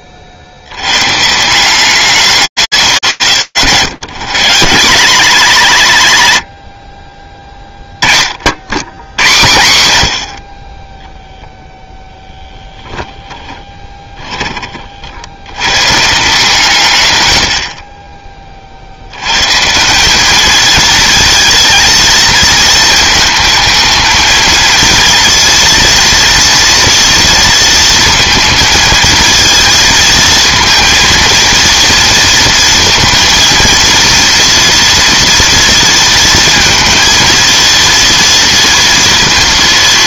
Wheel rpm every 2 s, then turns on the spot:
110, 190, 190, 40, 90, 0, 10, 100, 80, 150, 230, 220, 230, 230, 230, 230, 230, 230, 230, 230.
12-14